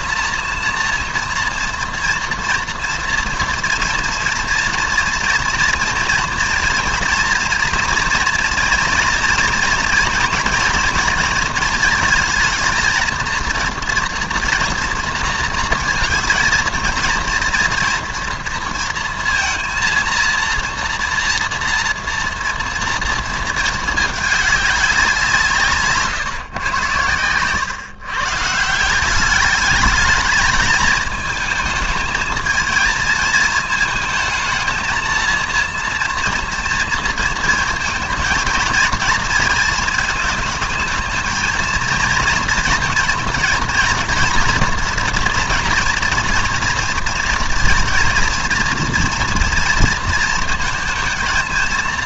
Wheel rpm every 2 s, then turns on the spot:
230, 230, 240, 240, 230, 230, 230, 230, 230, 230, 230, 230, 200, 110, 160, 220, 220, 220, 230, 230, 230, 240, 240, 230, 230, 230.
none